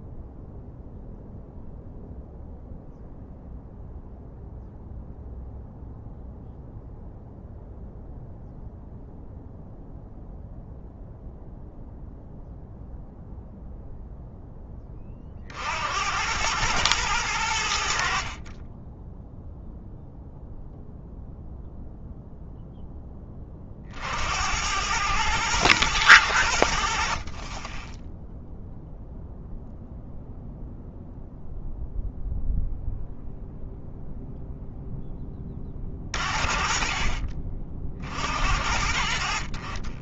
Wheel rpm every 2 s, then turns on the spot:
0, 0, 0, 0, 0, 0, 0, 40, 100, 20, 0, 10, 100, 70, 0, 0, 0, 10, 30, 60.
none